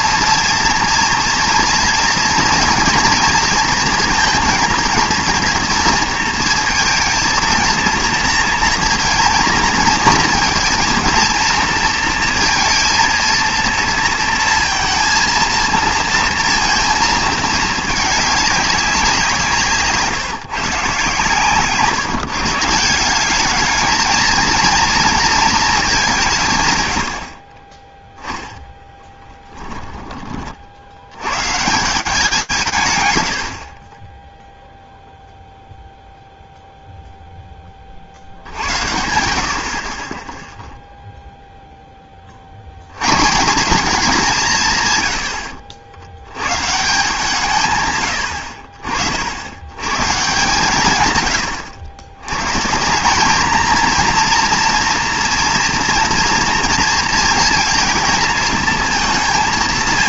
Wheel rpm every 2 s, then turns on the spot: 230, 230, 230, 220, 230, 230, 230, 230, 230, 200, 150, 160, 220, 120, 10, 30, 150, 0, 0, 80, 0, 140, 100, 160, 60, 120, 180, 230, 230, 190.
none